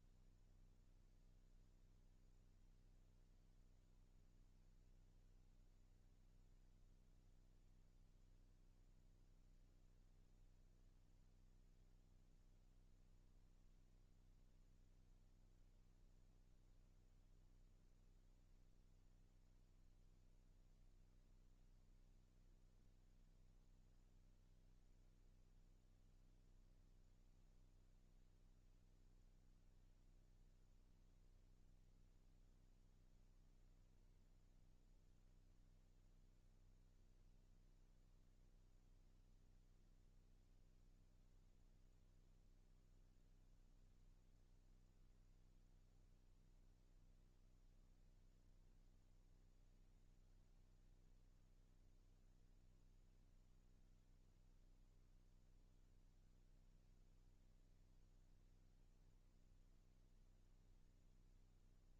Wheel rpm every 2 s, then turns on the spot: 0, 0, 0, 0, 0, 0, 0, 0, 0, 0, 0, 0, 0, 0, 0, 0, 0, 0, 0, 0, 0, 0, 0, 0, 0, 0, 0, 0, 0, 0, 0.
none